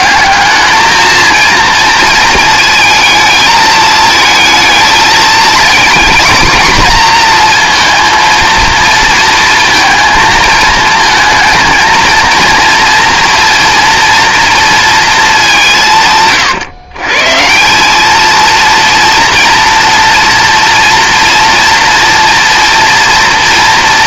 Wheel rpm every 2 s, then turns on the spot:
220, 220, 220, 230, 230, 220, 230, 230, 130, 230, 230, 240.
none